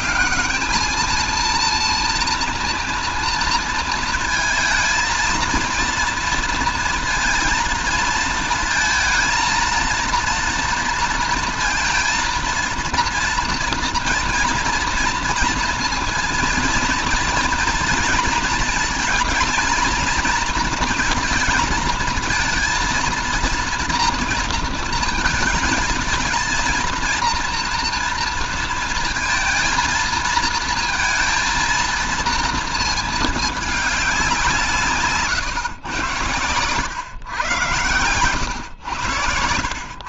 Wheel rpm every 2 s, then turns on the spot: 210, 230, 230, 230, 230, 230, 230, 230, 230, 230, 230, 220, 230, 230, 230, 230, 230, 170, 120, 110.
none